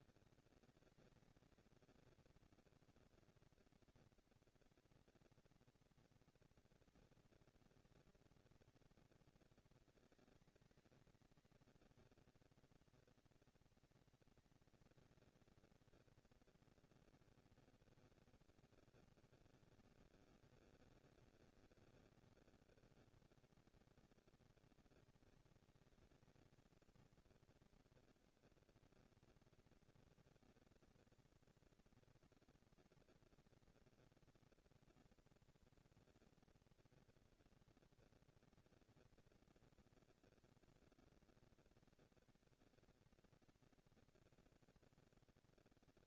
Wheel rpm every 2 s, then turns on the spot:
220, 240, 230, 230, 230, 220, 230, 230, 230, 210, 190, 210, 220, 230, 230, 230, 230, 230, 230, 230, 230, 230, 240.
none